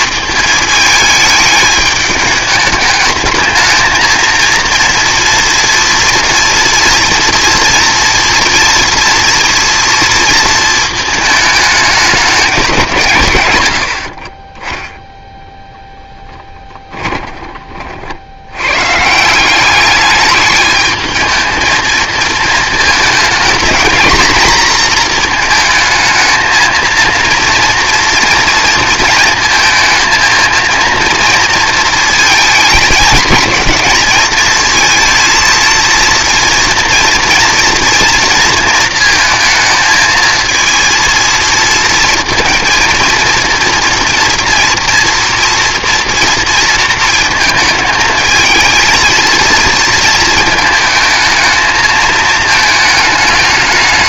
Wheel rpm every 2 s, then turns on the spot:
220, 210, 230, 240, 230, 230, 190, 10, 20, 120, 220, 220, 230, 230, 230, 230, 220, 220, 230, 230, 230, 230, 230, 230, 220, 220, 220.
16-18